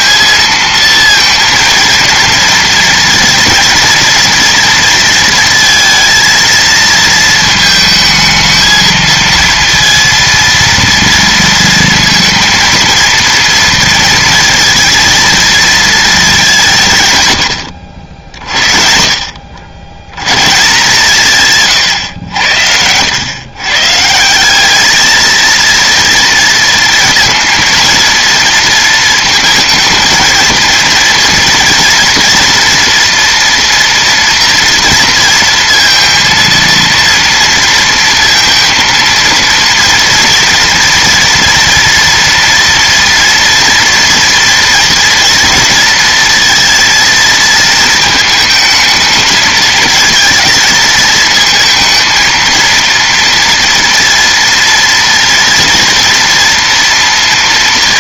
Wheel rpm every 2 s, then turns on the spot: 230, 230, 230, 230, 220, 230, 230, 230, 170, 60, 140, 90, 210, 230, 230, 230, 230, 230, 230, 230, 230, 230, 230, 230, 220, 220, 230, 230, 240.
none